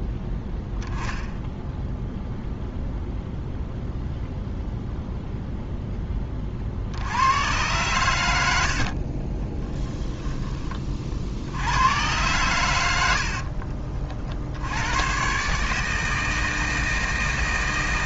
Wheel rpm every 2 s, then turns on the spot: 0, 0, 0, 60, 60, 40, 90, 90, 160.
8-10